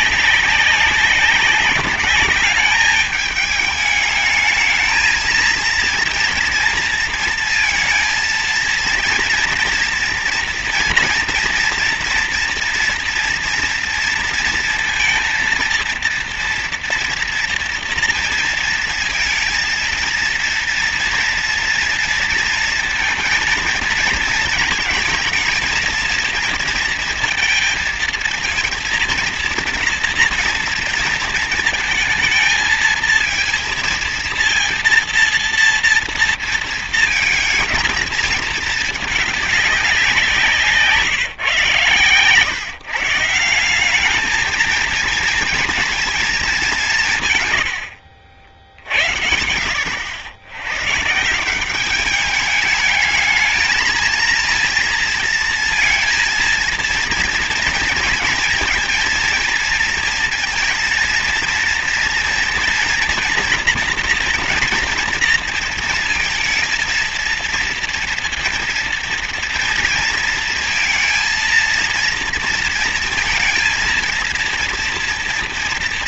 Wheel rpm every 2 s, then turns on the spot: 190, 210, 220, 230, 230, 230, 230, 230, 230, 230, 230, 230, 230, 230, 230, 230, 220, 230, 230, 220, 170, 140, 220, 180, 60, 120, 210, 230, 230, 230, 230, 230, 230, 230, 230, 230, 230, 230.
none